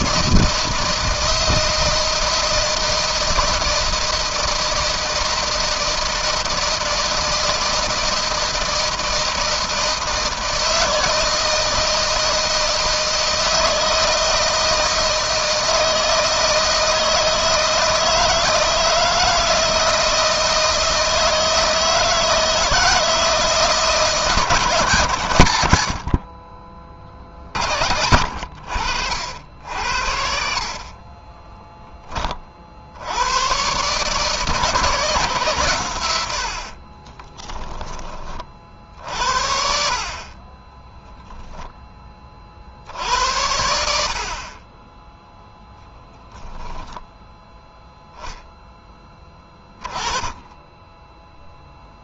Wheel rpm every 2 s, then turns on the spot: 160, 160, 160, 160, 160, 160, 160, 160, 160, 160, 160, 160, 140, 50, 70, 30, 80, 140, 30, 50, 10, 60, 10, 0, 10, 10.
30-32 36-38 40-42